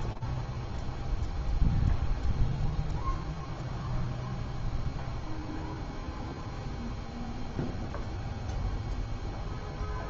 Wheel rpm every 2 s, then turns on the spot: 0, 0, 0, 0, 0.
none